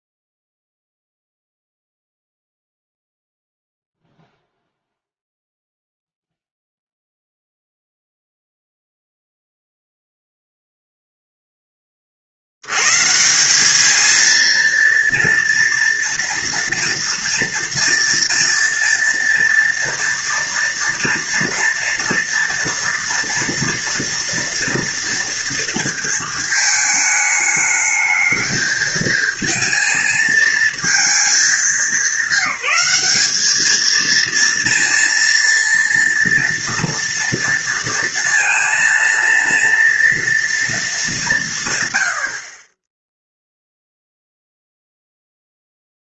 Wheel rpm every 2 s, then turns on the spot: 0, 0, 0, 0, 0, 0, 100, 230, 230, 230, 230, 230, 230, 220, 220, 220, 210, 230, 230, 230, 220, 20, 0.
none